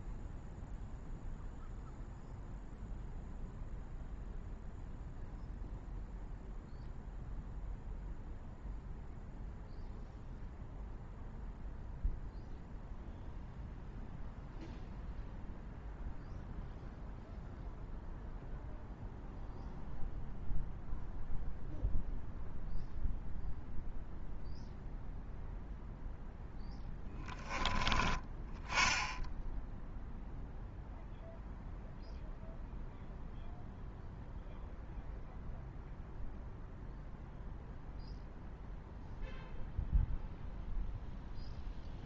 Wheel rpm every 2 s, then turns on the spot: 0, 0, 0, 0, 0, 0, 0, 0, 0, 0, 0, 0, 0, 10, 10, 0, 0, 0, 0, 0, 0.
none